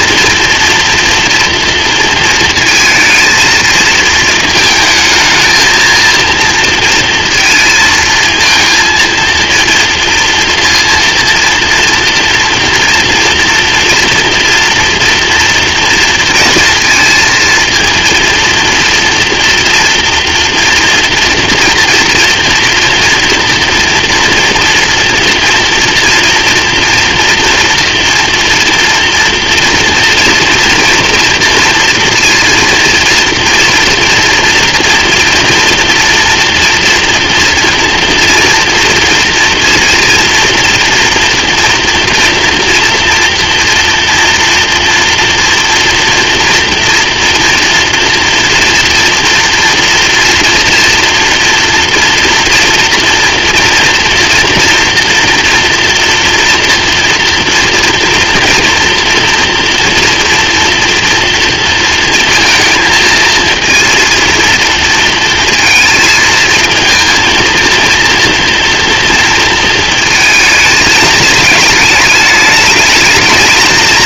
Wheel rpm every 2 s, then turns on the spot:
230, 230, 220, 230, 230, 230, 230, 240, 230, 230, 230, 230, 230, 230, 230, 230, 230, 240, 240, 240, 230, 240, 230, 230, 230, 230, 230, 240, 240, 230, 230, 230, 230, 230, 230, 220, 220.
none